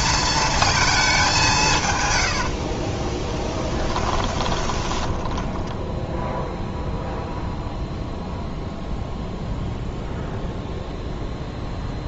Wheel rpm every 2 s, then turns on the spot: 230, 50, 20, 0, 0, 0.
2-6